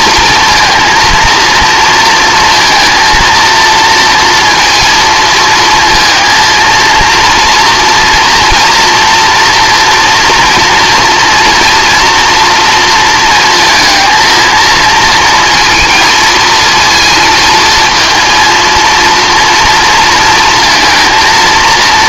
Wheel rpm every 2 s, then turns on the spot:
230, 220, 230, 230, 230, 230, 230, 230, 230, 230, 230.
none